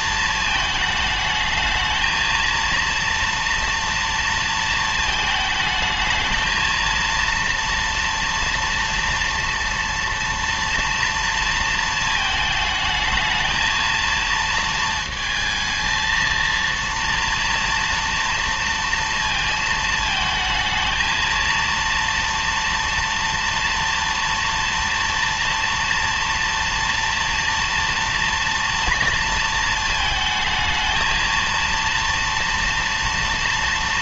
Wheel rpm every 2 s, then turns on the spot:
220, 230, 230, 230, 230, 230, 220, 230, 230, 230, 220, 230, 230, 230, 230, 220, 230.
none